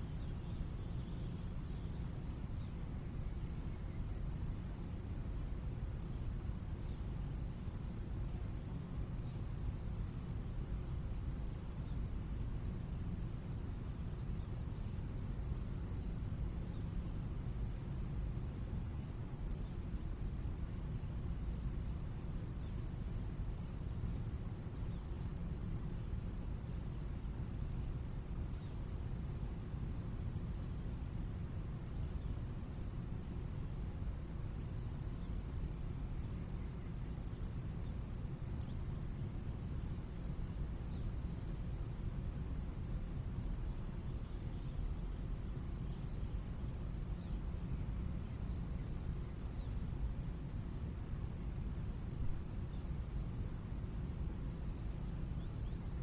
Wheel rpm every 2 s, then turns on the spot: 0, 0, 0, 0, 0, 0, 0, 0, 0, 0, 0, 0, 0, 0, 0, 0, 0, 0, 0, 0, 0, 0, 0, 0, 0, 0, 0, 0.
none